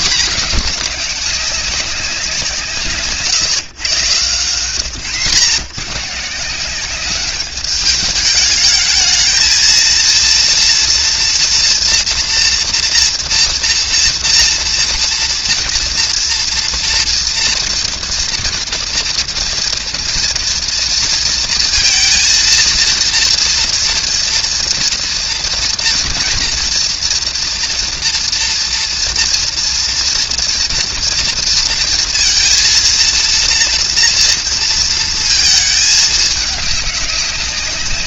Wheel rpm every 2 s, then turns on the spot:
210, 160, 130, 180, 220, 230, 230, 230, 230, 230, 230, 230, 230, 230, 230, 230, 230, 230, 210.
none